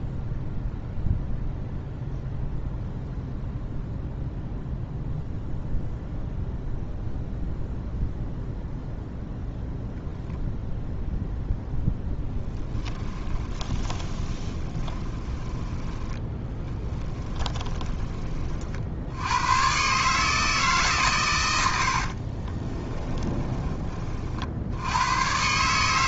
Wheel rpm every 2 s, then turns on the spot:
0, 0, 0, 0, 0, 0, 10, 20, 20, 60, 150, 20, 70.
12-18 22-24